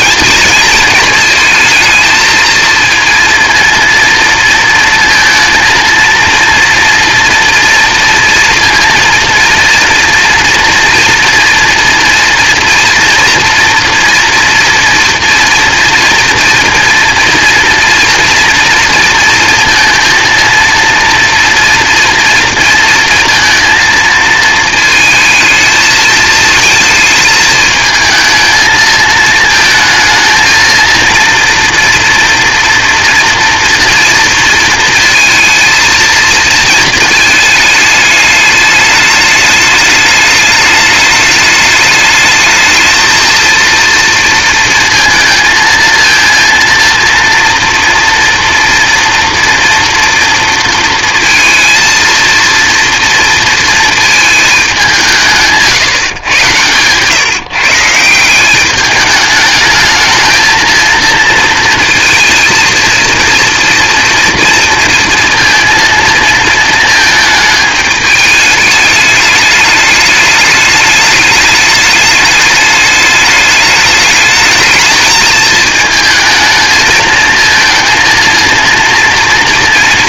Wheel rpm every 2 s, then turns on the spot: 230, 230, 230, 240, 230, 230, 230, 240, 230, 230, 230, 230, 220, 220, 220, 230, 230, 230, 230, 210, 210, 220, 230, 230, 230, 230, 230, 190, 120, 200, 230, 230, 230, 220, 210, 210, 210, 210, 220, 230.
none